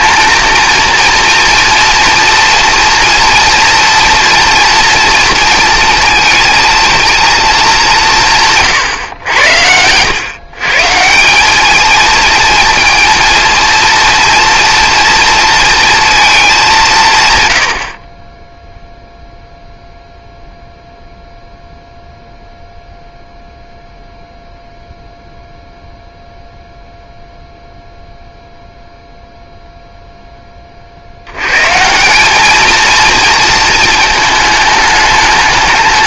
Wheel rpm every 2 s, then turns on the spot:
230, 230, 230, 220, 140, 150, 230, 230, 170, 0, 0, 0, 0, 0, 0, 40, 220, 210.
none